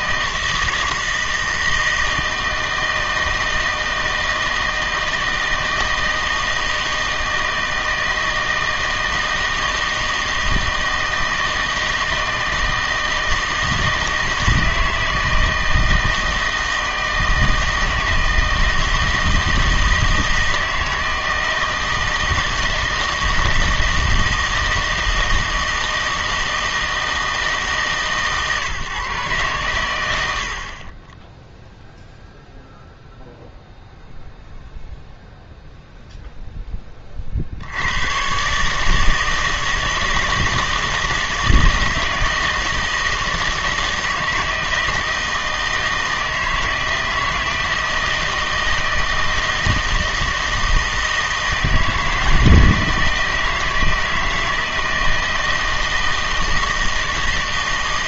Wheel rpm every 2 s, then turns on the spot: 160, 160, 160, 160, 160, 160, 160, 160, 160, 160, 160, 160, 160, 160, 140, 50, 0, 0, 20, 150, 160, 160, 160, 160, 160, 160, 160, 160, 160.
none